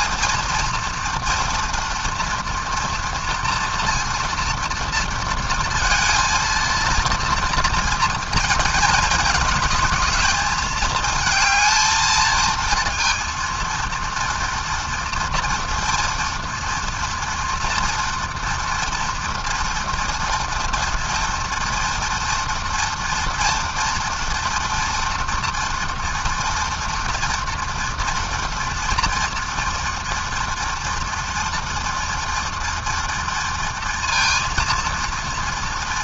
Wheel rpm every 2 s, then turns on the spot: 230, 240, 230, 230, 220, 220, 230, 230, 230, 230, 230, 230, 240, 230, 230, 230, 230, 230.
none